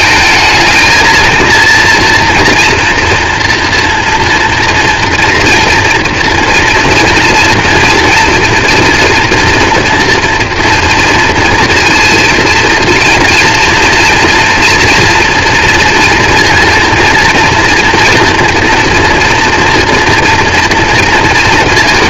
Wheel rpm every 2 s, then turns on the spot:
220, 230, 230, 230, 230, 240, 230, 230, 230, 230, 230.
none